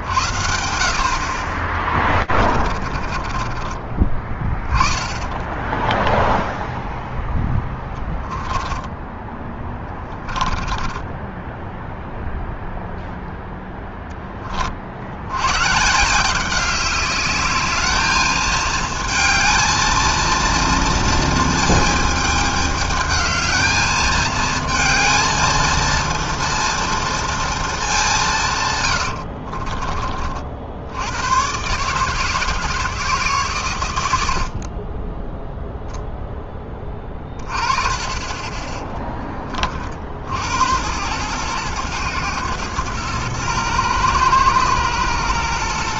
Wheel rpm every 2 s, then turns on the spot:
60, 30, 30, 0, 10, 10, 0, 20, 190, 220, 230, 220, 220, 230, 160, 60, 150, 70, 10, 20, 80, 120, 110.
2-4 8-12